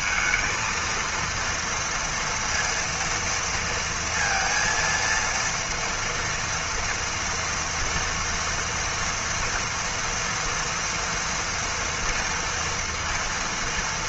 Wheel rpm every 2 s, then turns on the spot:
220, 230, 230, 230, 230, 230, 230.
none